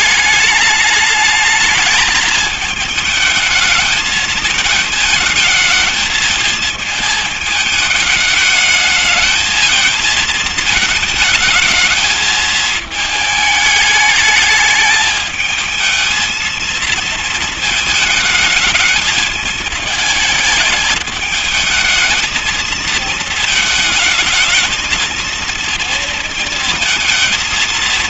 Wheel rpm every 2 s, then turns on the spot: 210, 220, 220, 220, 210, 220, 220, 210, 220, 220, 220, 220, 230, 230.
none